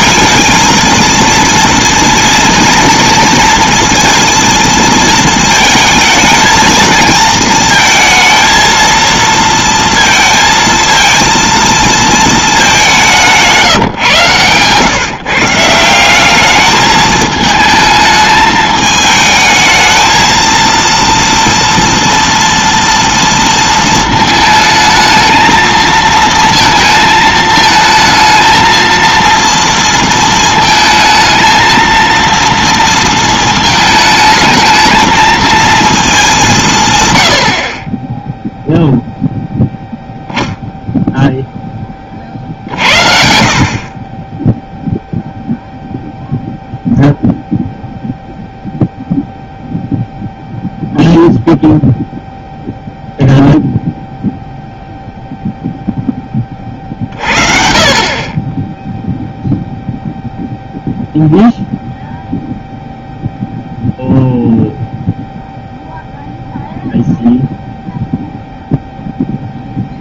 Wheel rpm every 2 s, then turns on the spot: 230, 230, 230, 220, 230, 220, 200, 120, 210, 220, 230, 230, 220, 230, 230, 220, 230, 220, 150, 0, 0, 50, 0, 0, 0, 0, 0, 0, 40, 0, 0, 0, 0, 0, 0.
none